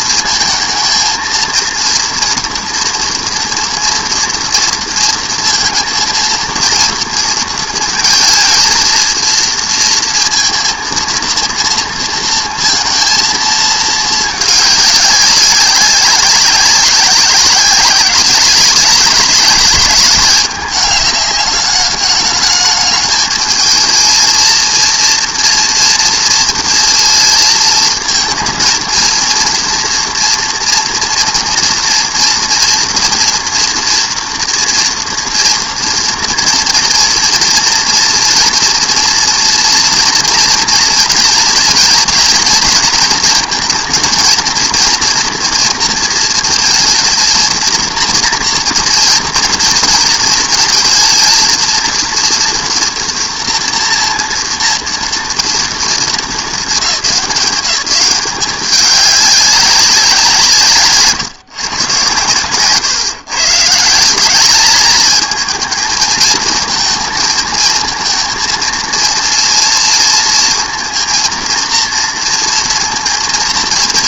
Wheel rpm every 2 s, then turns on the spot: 220, 240, 230, 230, 230, 230, 230, 210, 190, 200, 200, 210, 230, 230, 230, 240, 230, 240, 230, 230, 230, 220, 230, 220, 230, 230, 230, 230, 210, 190, 160, 110, 200, 220, 230, 230, 230.
none